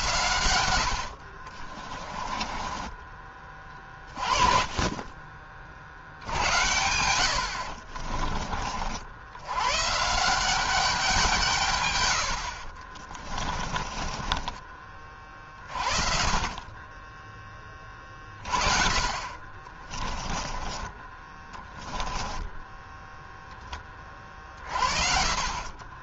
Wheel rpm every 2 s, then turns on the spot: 70, 20, 30, 80, 60, 190, 40, 30, 20, 40, 20, 10, 40.
12-14 18-20 24-26